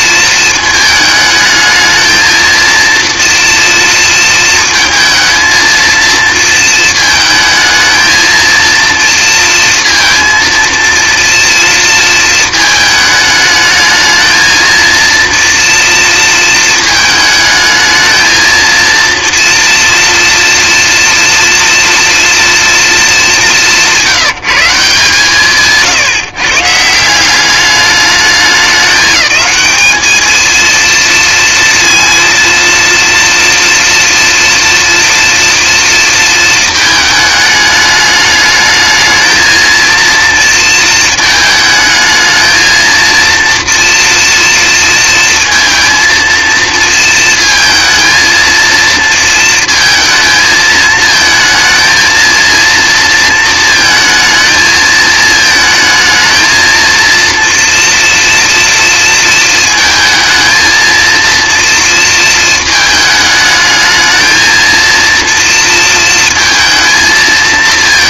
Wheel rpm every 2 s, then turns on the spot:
220, 230, 220, 220, 230, 230, 220, 230, 220, 230, 240, 220, 160, 160, 200, 230, 230, 230, 220, 220, 230, 220, 230, 230, 230, 220, 230, 220, 230, 230, 230, 220, 230, 230.
none